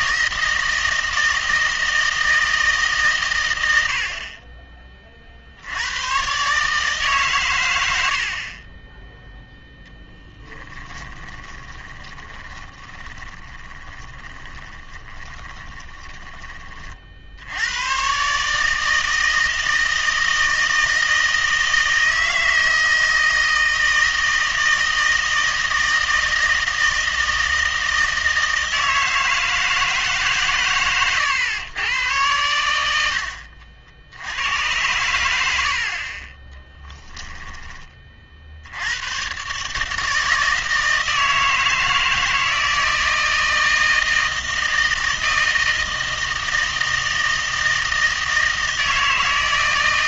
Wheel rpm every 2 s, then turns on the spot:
160, 150, 30, 150, 20, 20, 20, 30, 40, 160, 160, 160, 160, 160, 160, 120, 90, 100, 10, 80, 160, 160, 160, 160, 160.
10-16 36-38